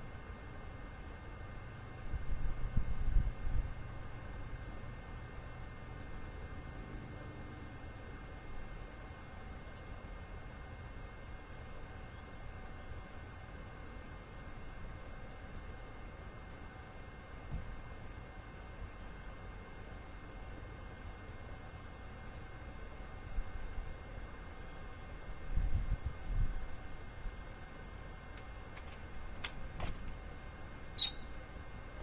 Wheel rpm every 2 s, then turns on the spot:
0, 0, 0, 0, 0, 0, 0, 0, 0, 0, 0, 0, 0, 0, 0, 0.
none